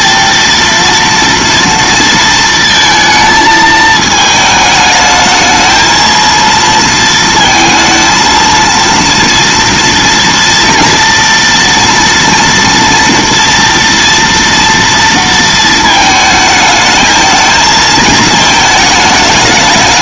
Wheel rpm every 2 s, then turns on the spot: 230, 230, 220, 230, 230, 230, 230, 230, 220, 220.
none